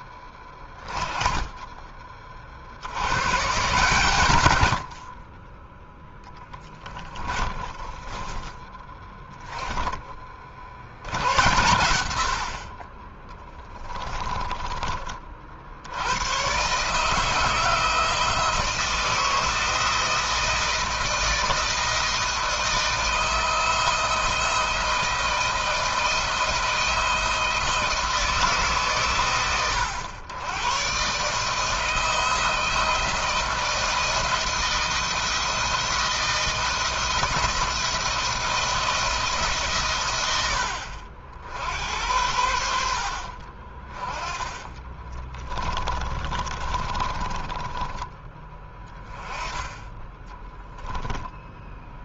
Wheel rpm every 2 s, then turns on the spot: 20, 90, 50, 10, 10, 70, 20, 30, 150, 160, 160, 160, 160, 160, 140, 130, 170, 170, 170, 160, 70, 70, 20, 30, 20, 10.
6-8 44-48